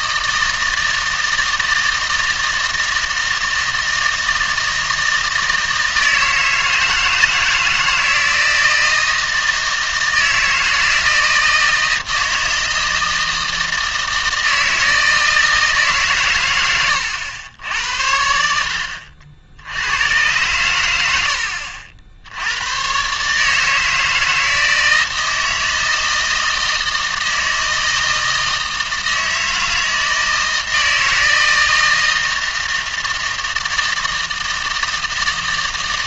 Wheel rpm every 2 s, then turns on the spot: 160, 160, 160, 160, 160, 160, 160, 160, 110, 80, 100, 110, 160, 160, 160, 160, 160, 160.
none